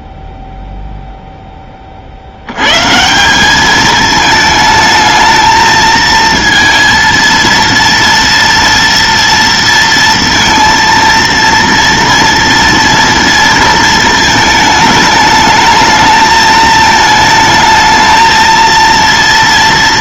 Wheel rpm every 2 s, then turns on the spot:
0, 120, 220, 230, 230, 230, 230, 220, 220, 230.
none